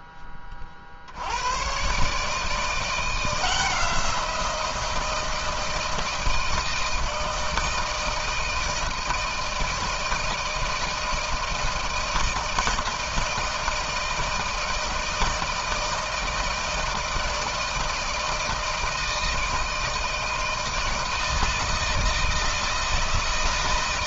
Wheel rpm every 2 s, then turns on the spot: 40, 160, 170, 160, 160, 160, 160, 160, 160, 160, 160, 160.
none